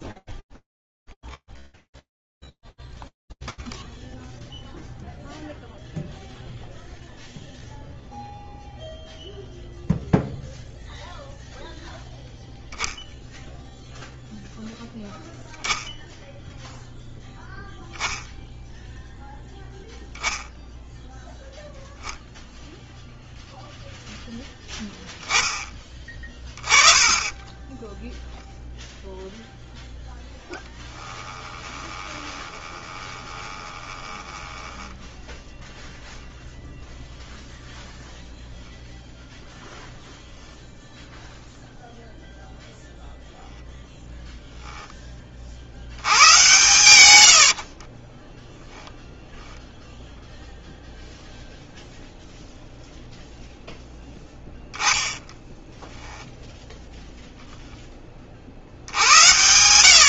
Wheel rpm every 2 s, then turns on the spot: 0, 0, 0, 0, 0, 0, 0, 10, 0, 0, 0, 0, 20, 0, 0, 20, 20, 0, 0, 0, 0, 0, 80, 40, 0, 0, 0, 10, 0, 110.
30-34 46-48 54-56